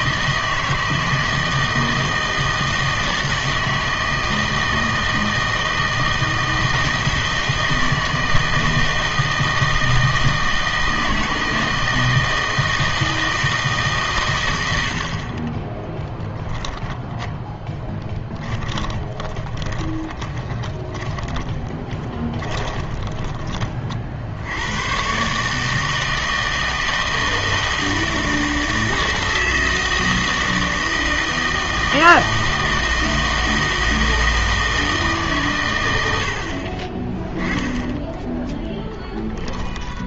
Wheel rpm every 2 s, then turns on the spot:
160, 160, 160, 160, 160, 160, 160, 80, 10, 20, 20, 20, 100, 160, 160, 160, 160, 160, 30, 10.
18-24